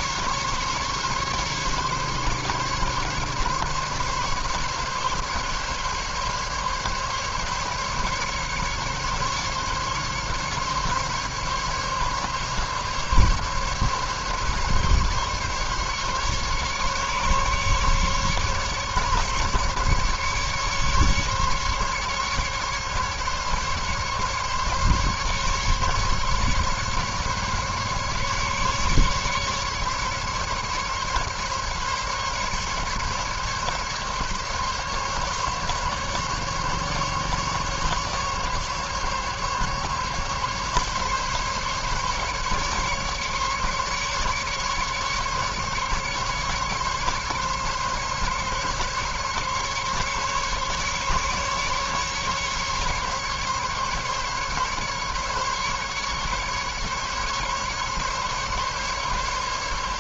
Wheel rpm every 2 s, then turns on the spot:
140, 140, 140, 140, 140, 140, 140, 140, 140, 140, 150, 140, 140, 140, 140, 140, 150, 140, 140, 140, 140, 140, 150, 140, 140, 140, 140, 140, 140, 140.
none